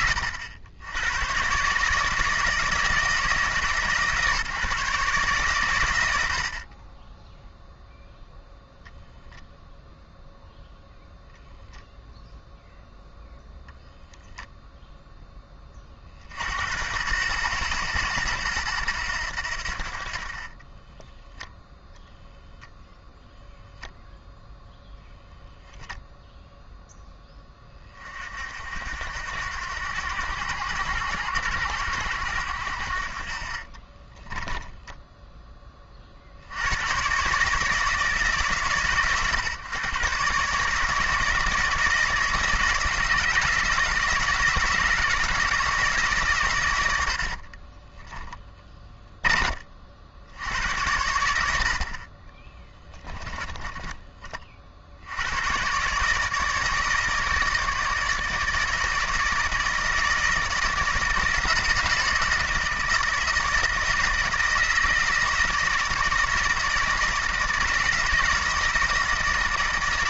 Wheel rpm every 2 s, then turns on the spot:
90, 160, 150, 20, 0, 0, 10, 0, 90, 90, 10, 0, 10, 10, 80, 100, 60, 10, 110, 130, 160, 160, 160, 90, 20, 100, 10, 70, 160, 160, 160, 160, 160, 160, 160.
20-22 24-26 48-50 52-54